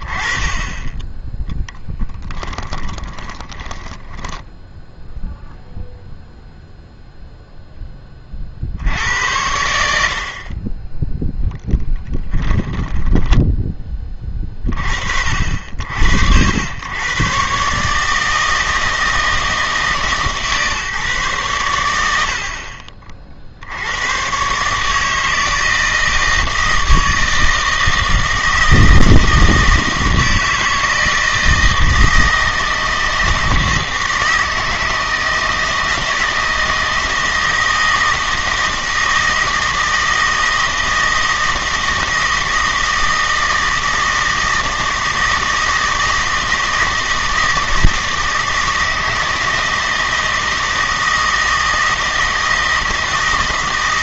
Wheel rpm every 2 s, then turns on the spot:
20, 20, 0, 0, 70, 30, 10, 40, 100, 160, 140, 50, 150, 160, 160, 160, 160, 160, 160, 160, 160, 160, 160, 160, 160, 160, 160.
2-4 12-14